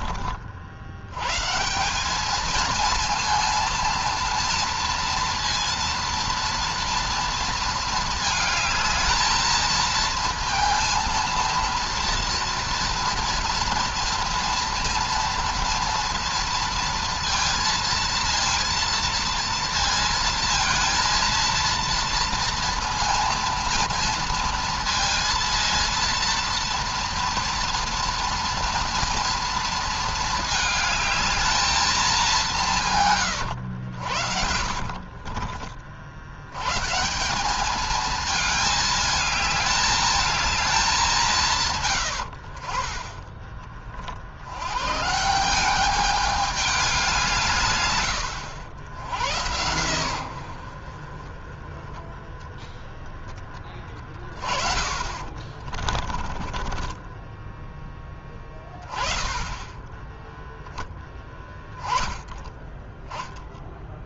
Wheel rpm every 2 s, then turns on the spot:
50, 220, 230, 230, 220, 230, 230, 230, 230, 230, 230, 230, 230, 230, 230, 220, 190, 60, 100, 220, 220, 70, 70, 210, 80, 80, 10, 30, 20, 10, 10, 10.
34-36 54-58